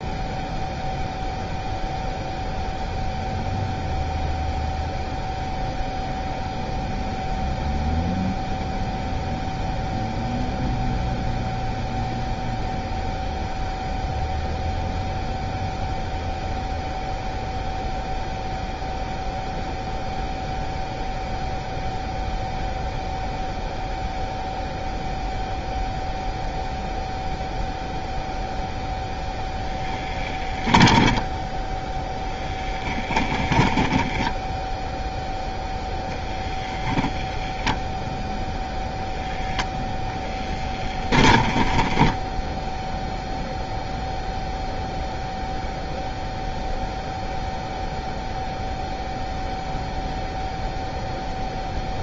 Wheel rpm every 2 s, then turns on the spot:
0, 0, 0, 0, 0, 0, 0, 0, 0, 0, 0, 0, 0, 0, 0, 10, 10, 10, 10, 0, 10, 10, 0, 0, 0, 0.
30-36